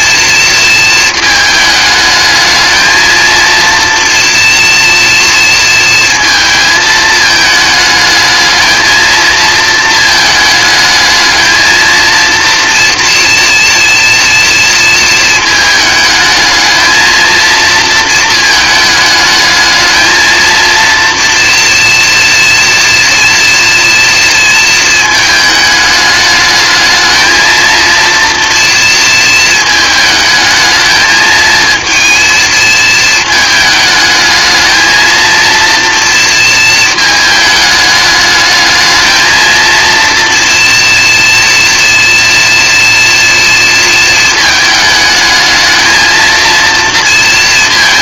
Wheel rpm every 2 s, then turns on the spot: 230, 220, 230, 220, 220, 220, 230, 230, 230, 220, 230, 230, 220, 220, 230, 220, 220, 220, 220, 220, 230, 230, 220, 230.
none